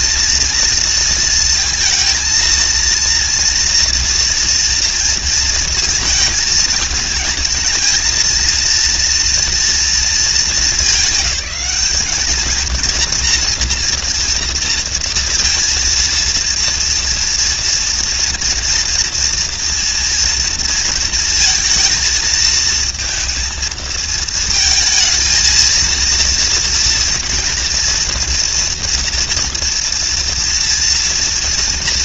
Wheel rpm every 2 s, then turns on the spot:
230, 230, 230, 220, 230, 190, 230, 230, 230, 230, 230, 230, 230, 230, 230, 230.
none